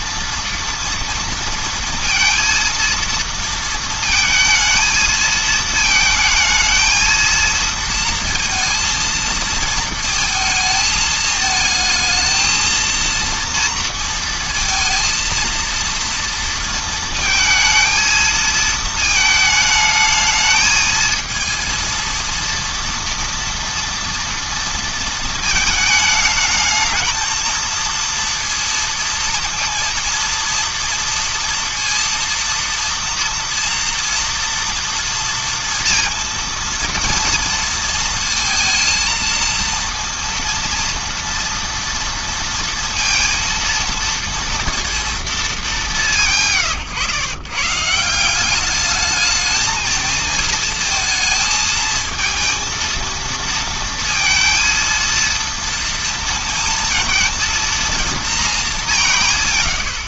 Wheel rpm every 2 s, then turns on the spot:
230, 230, 220, 220, 230, 220, 230, 230, 230, 220, 220, 230, 230, 220, 230, 230, 230, 230, 230, 220, 230, 230, 230, 120, 200, 220, 230, 230, 230, 210.
none